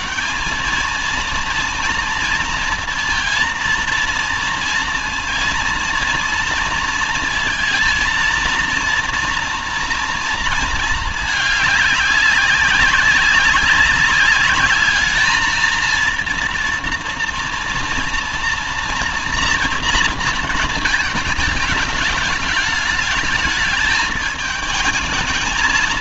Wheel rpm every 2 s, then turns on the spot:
220, 230, 230, 230, 230, 220, 190, 210, 230, 230, 220, 210, 220.
none